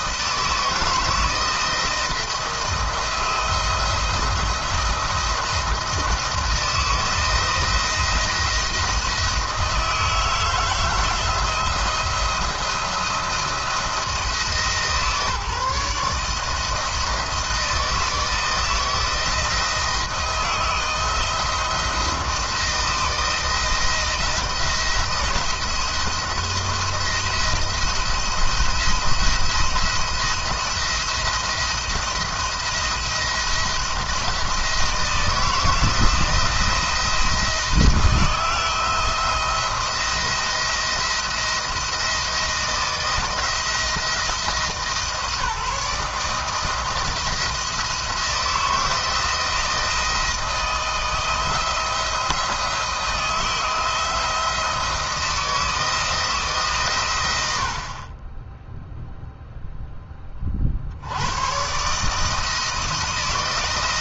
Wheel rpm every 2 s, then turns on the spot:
160, 170, 170, 170, 160, 170, 170, 150, 160, 160, 160, 160, 170, 170, 170, 170, 170, 170, 170, 170, 170, 160, 160, 170, 160, 160, 160, 160, 140, 0, 50, 160.
none